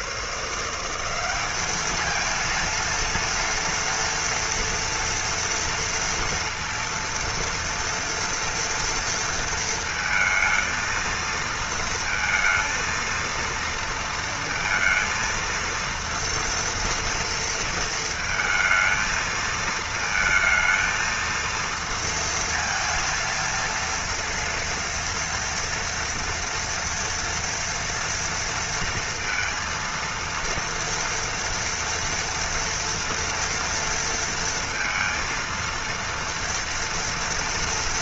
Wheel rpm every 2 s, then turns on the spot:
160, 230, 230, 230, 230, 220, 230, 230, 230, 220, 230, 230, 230, 230, 230, 230, 230, 230, 230.
none